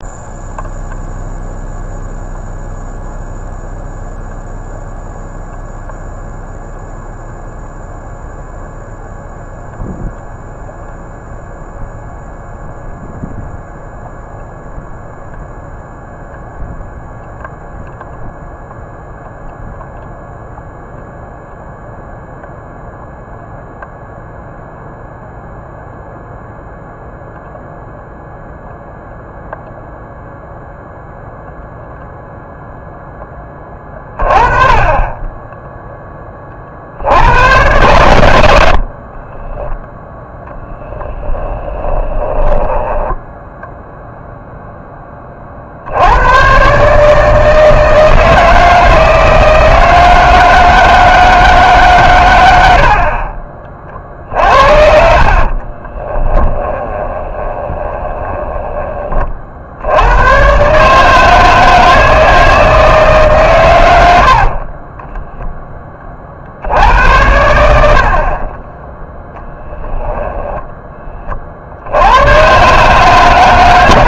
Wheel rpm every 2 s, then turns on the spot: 0, 0, 0, 0, 0, 0, 0, 0, 0, 0, 0, 0, 0, 0, 0, 0, 0, 20, 60, 60, 10, 10, 0, 140, 160, 160, 80, 50, 20, 20, 140, 160, 30, 70, 20, 10, 140.
38-44 54-58 64-66 68-70